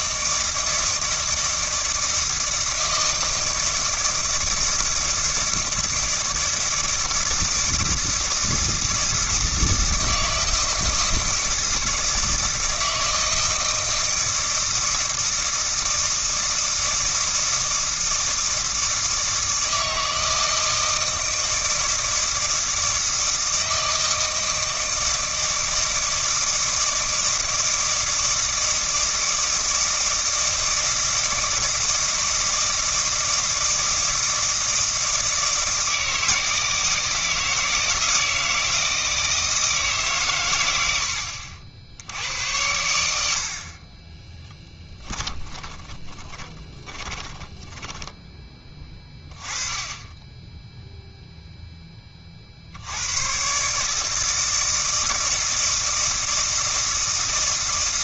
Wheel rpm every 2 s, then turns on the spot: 160, 160, 160, 160, 160, 160, 160, 160, 160, 160, 160, 160, 160, 160, 160, 160, 160, 160, 160, 160, 90, 90, 10, 30, 20, 0, 80, 160, 160.
44-48